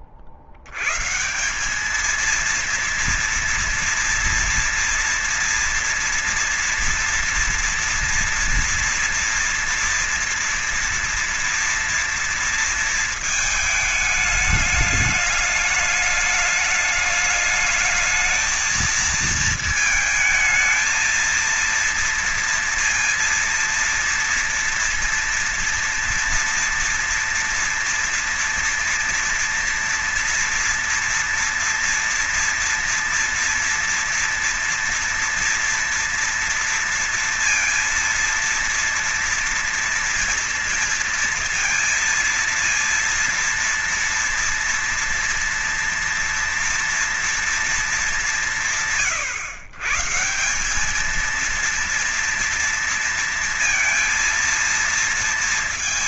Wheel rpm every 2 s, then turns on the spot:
60, 230, 240, 230, 240, 240, 230, 210, 210, 220, 220, 230, 230, 240, 230, 230, 230, 230, 230, 230, 230, 230, 240, 230, 160, 190, 230, 230.
none